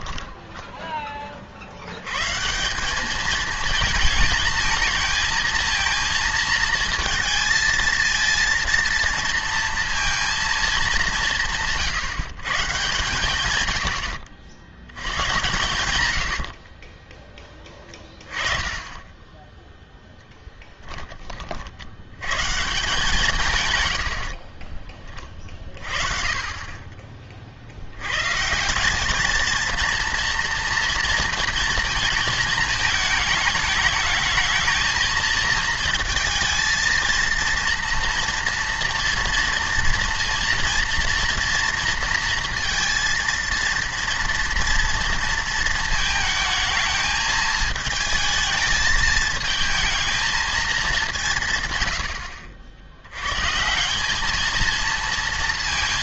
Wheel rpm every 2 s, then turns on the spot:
10, 170, 220, 230, 230, 220, 140, 80, 60, 20, 10, 140, 30, 30, 170, 230, 220, 220, 230, 240, 230, 230, 230, 220, 220, 210, 70, 230.
16-18 24-26